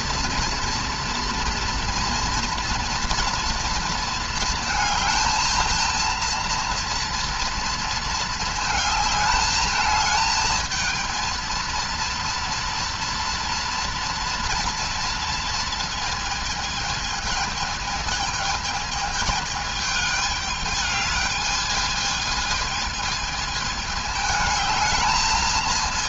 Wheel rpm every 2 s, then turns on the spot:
230, 240, 230, 230, 220, 220, 230, 230, 230, 220, 210, 220, 220.
none